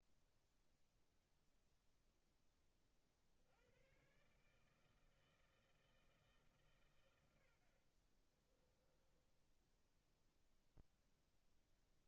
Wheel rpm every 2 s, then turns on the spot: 0, 10, 150, 140, 20, 0.
8-10